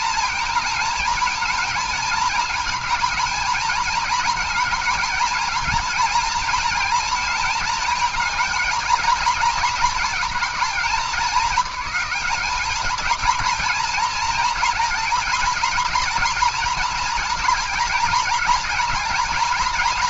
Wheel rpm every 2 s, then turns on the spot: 230, 220, 220, 220, 220, 210, 220, 230, 240, 230.
none